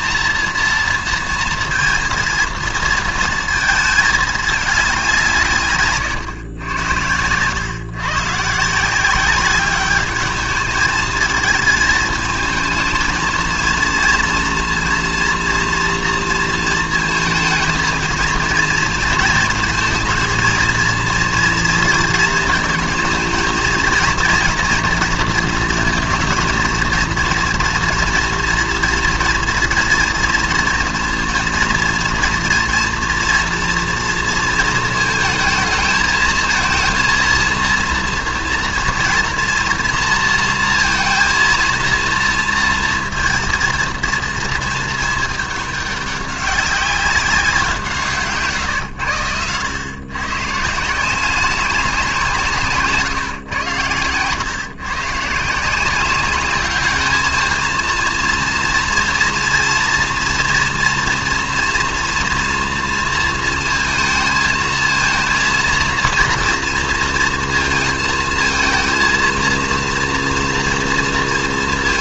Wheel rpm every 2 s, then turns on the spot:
230, 230, 200, 100, 160, 210, 220, 230, 230, 230, 230, 220, 230, 230, 230, 230, 230, 230, 230, 230, 230, 230, 220, 190, 140, 150, 140, 130, 200, 230, 240, 230, 220, 230, 230, 230.
none